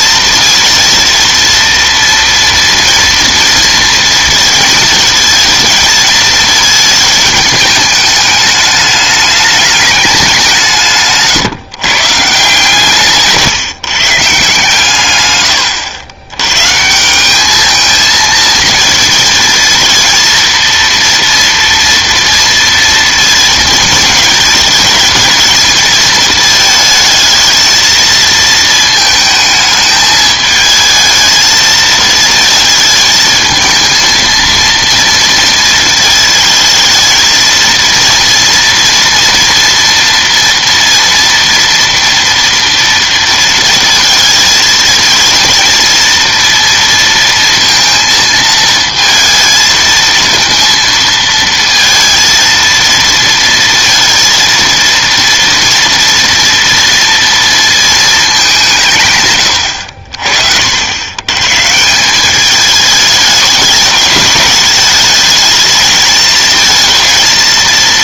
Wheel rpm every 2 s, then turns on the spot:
230, 230, 220, 220, 210, 170, 130, 140, 140, 230, 230, 230, 220, 220, 220, 220, 220, 230, 220, 230, 230, 230, 220, 230, 230, 230, 230, 230, 230, 200, 60, 210, 210, 220.
none